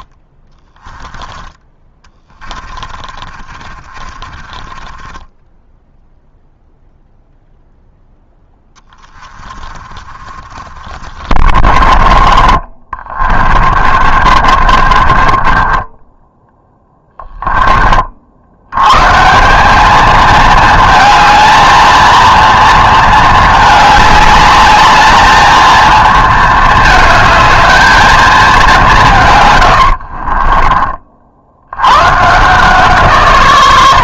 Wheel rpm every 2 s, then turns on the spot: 20, 40, 40, 0, 20, 50, 30, 40, 10, 100, 220, 230, 210, 220, 190, 30, 160.
0-6 8-12 14-18 30-32